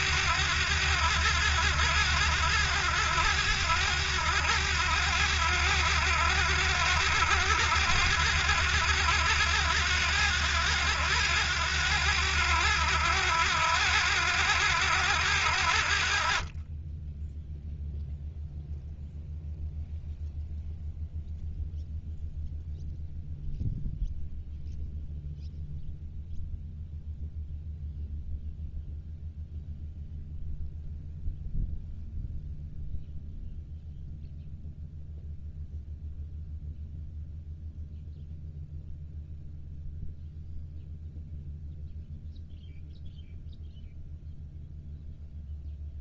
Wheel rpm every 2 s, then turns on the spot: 70, 70, 70, 70, 70, 70, 70, 70, 20, 0, 0, 0, 0, 0, 0, 0, 0, 0, 0, 0, 0, 0, 0.
none